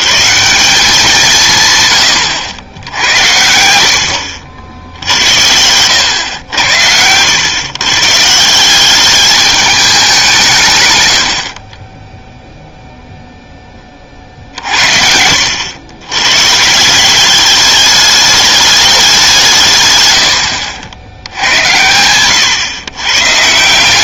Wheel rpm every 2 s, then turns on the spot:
180, 90, 70, 100, 180, 140, 0, 50, 150, 210, 70, 120.
none